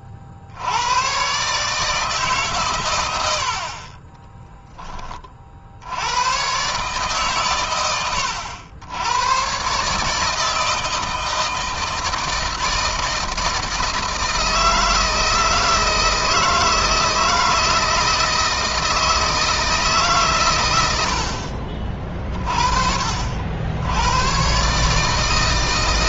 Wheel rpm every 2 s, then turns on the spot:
90, 130, 20, 130, 100, 160, 160, 160, 160, 160, 110, 40, 140.
none